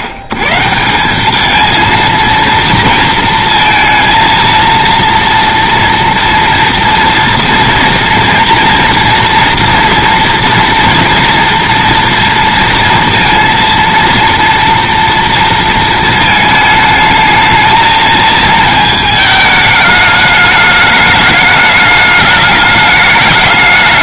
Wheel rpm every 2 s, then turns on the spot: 100, 230, 230, 230, 240, 230, 230, 230, 220, 220, 210, 210.
none